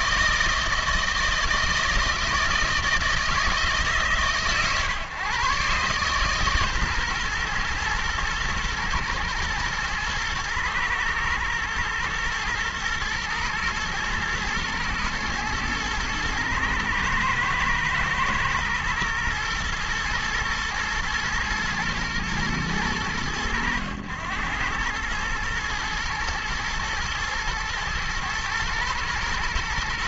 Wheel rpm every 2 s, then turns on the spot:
160, 160, 120, 140, 120, 120, 110, 120, 110, 120, 120, 110, 100, 110, 120.
none